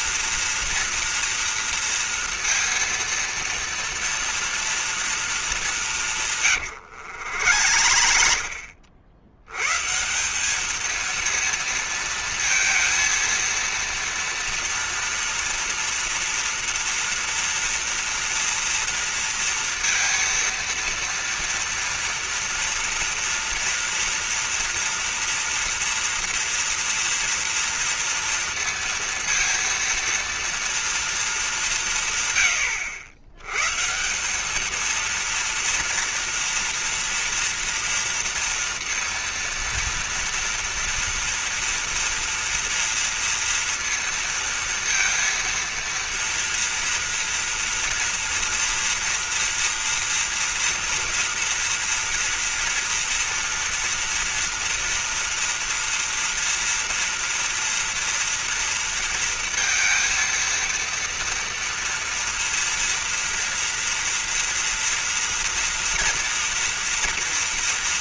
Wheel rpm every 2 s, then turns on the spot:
230, 230, 230, 150, 70, 190, 230, 230, 230, 230, 230, 230, 230, 230, 230, 230, 120, 200, 230, 230, 230, 230, 230, 230, 230, 230, 230, 230, 230, 230, 230, 230, 230, 230.
6-10